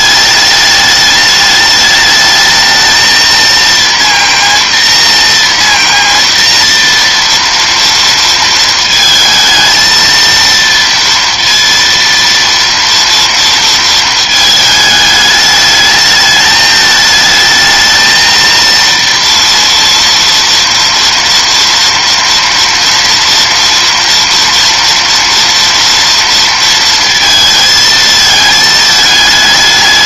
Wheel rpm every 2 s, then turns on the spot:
210, 220, 230, 230, 220, 230, 230, 220, 220, 230, 230, 230, 230, 230, 220.
none